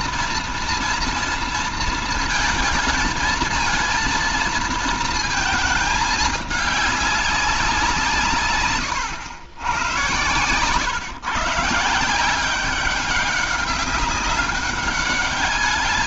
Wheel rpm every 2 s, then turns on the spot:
230, 220, 230, 210, 140, 120, 190, 200.
8-10